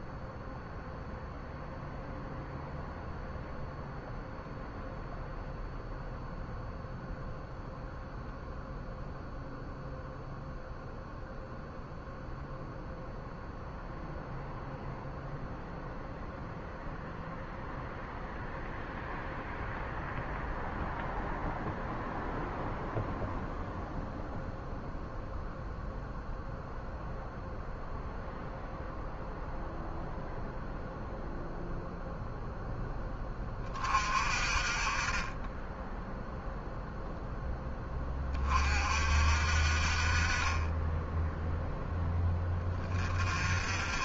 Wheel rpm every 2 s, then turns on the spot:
0, 0, 0, 0, 0, 0, 0, 0, 0, 0, 0, 0, 0, 0, 0, 0, 20, 20, 0, 50, 10, 30.
none